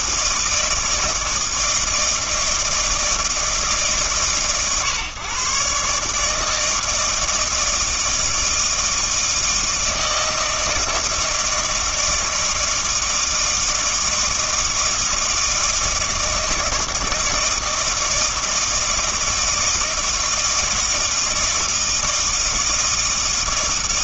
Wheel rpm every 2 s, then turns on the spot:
160, 160, 120, 160, 160, 160, 160, 160, 160, 160, 160, 160.
none